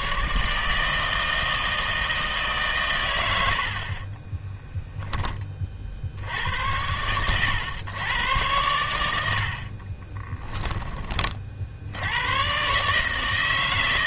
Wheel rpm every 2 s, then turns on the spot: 160, 140, 10, 90, 100, 20, 140.
none